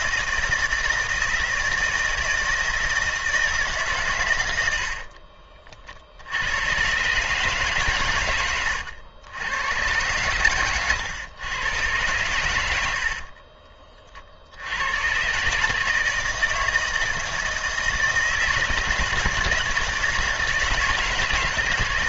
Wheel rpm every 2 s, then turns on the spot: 160, 160, 70, 120, 90, 110, 70, 100, 160, 160, 160.
4-6 12-14